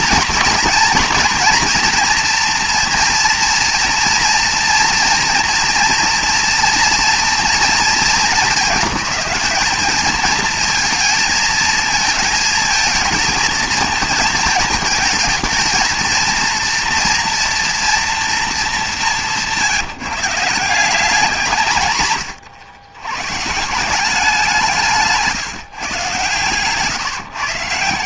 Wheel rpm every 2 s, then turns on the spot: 230, 230, 230, 230, 210, 220, 230, 220, 230, 220, 170, 120, 180, 130.
none